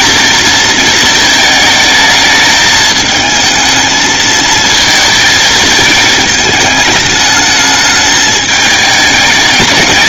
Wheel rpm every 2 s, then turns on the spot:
230, 220, 230, 220, 210.
none